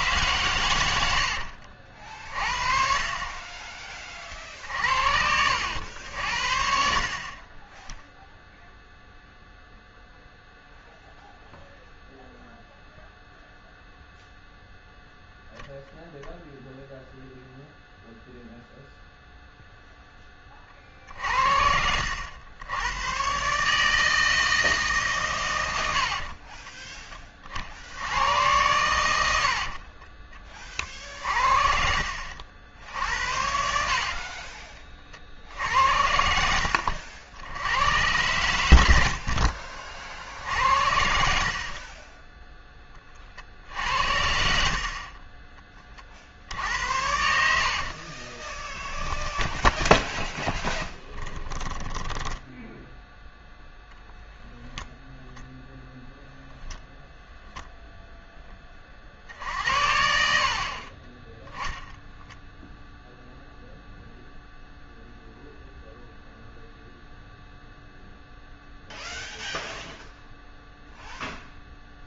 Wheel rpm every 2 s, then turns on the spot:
130, 50, 50, 60, 0, 0, 0, 0, 0, 0, 30, 100, 160, 30, 90, 30, 70, 30, 80, 100, 50, 10, 50, 70, 20, 10, 0, 0, 0, 10, 60, 0, 0, 0, 0, 0.
26-28 32-38 48-52 60-62